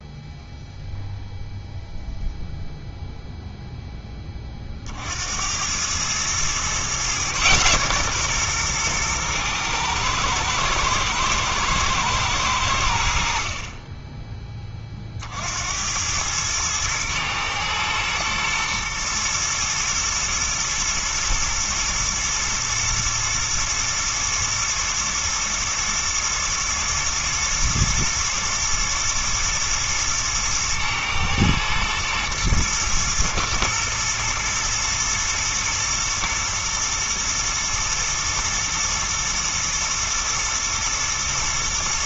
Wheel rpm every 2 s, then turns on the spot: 0, 0, 30, 120, 120, 110, 90, 20, 110, 110, 110, 120, 110, 110, 110, 110, 110, 110, 120, 110, 120.
none